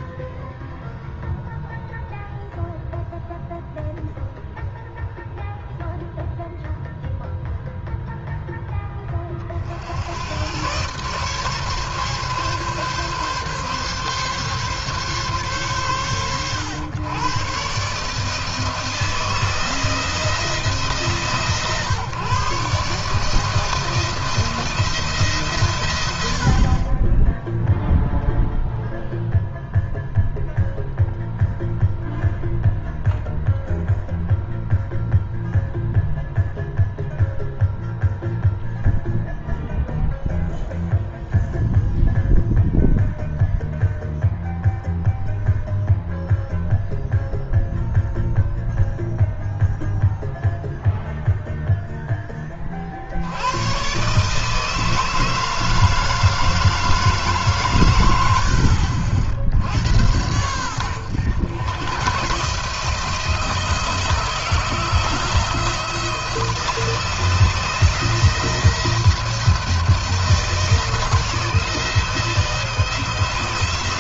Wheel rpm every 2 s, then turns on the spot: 10, 0, 0, 0, 10, 110, 140, 140, 110, 160, 160, 140, 170, 50, 0, 0, 0, 0, 0, 0, 0, 0, 0, 0, 0, 0, 30, 160, 160, 70, 90, 150, 160, 170, 170, 170, 170.
none